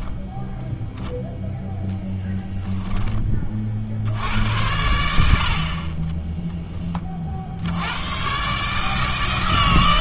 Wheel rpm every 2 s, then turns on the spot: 0, 0, 90, 20, 150.
none